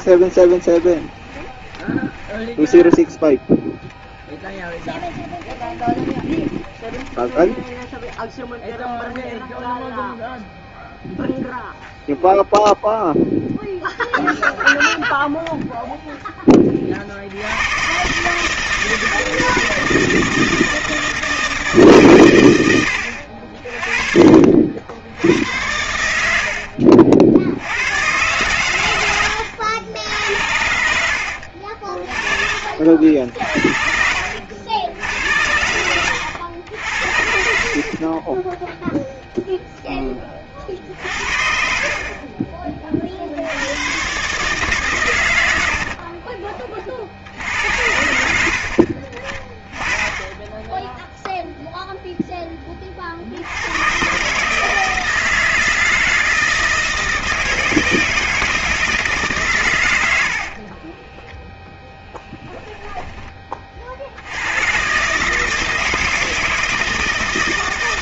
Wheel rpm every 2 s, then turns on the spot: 30, 10, 20, 20, 0, 0, 0, 0, 30, 160, 160, 90, 60, 50, 110, 70, 60, 90, 80, 10, 40, 30, 140, 30, 70, 10, 20, 160, 160, 160, 30, 10, 120, 160.
0-8 26-28 30-32 48-50 60-64